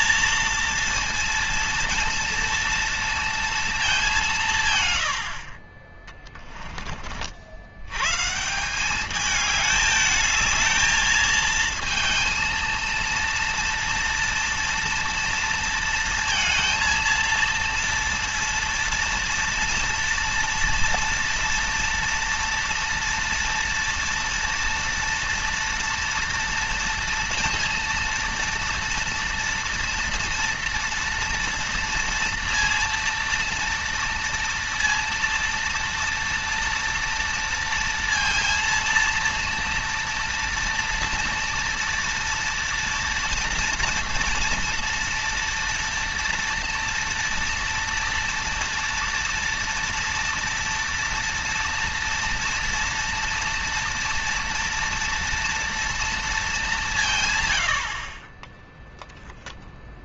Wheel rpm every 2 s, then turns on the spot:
230, 230, 150, 20, 170, 220, 230, 230, 230, 230, 230, 230, 230, 230, 230, 230, 230, 230, 240, 230, 230, 230, 230, 230, 230, 230, 230, 230, 210, 20.
none